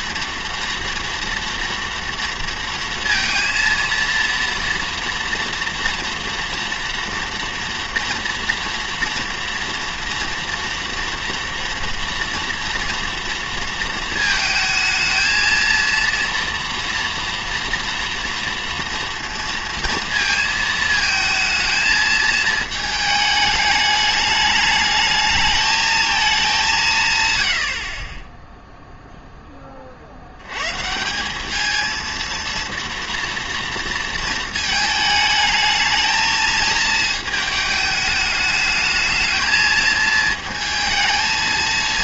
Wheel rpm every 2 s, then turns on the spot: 230, 230, 230, 230, 230, 230, 230, 220, 240, 240, 220, 220, 210, 190, 0, 120, 230, 220, 220, 210, 220.
none